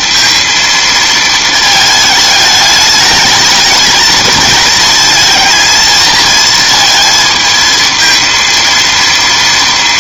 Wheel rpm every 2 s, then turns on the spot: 230, 210, 220, 230, 230.
none